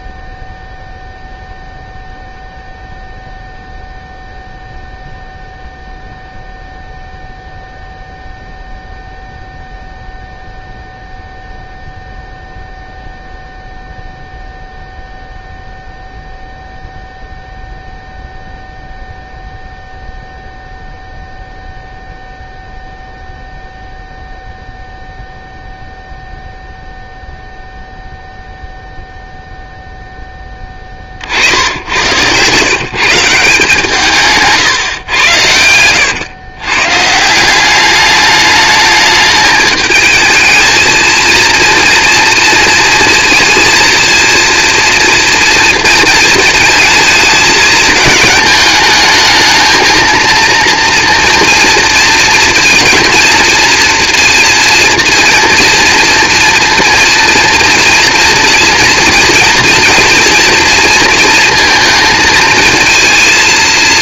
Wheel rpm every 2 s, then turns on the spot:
0, 0, 0, 0, 0, 0, 0, 0, 0, 0, 0, 0, 0, 0, 0, 10, 130, 140, 120, 210, 220, 230, 230, 220, 220, 230, 230, 230, 230, 230, 230, 220.
34-36